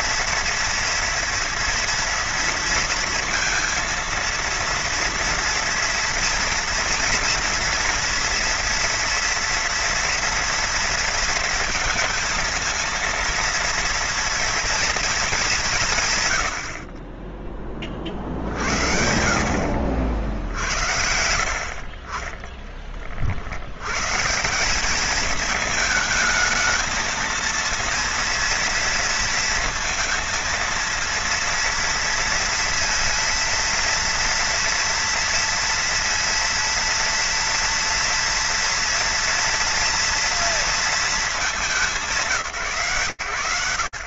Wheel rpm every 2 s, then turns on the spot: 230, 230, 230, 230, 230, 230, 220, 230, 110, 50, 60, 30, 160, 220, 230, 230, 230, 230, 230, 230, 230, 150.
none